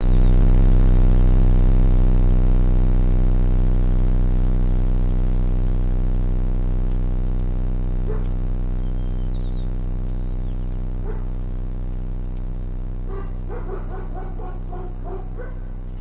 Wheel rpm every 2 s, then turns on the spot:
0, 0, 0, 0, 0, 0, 0, 0.
none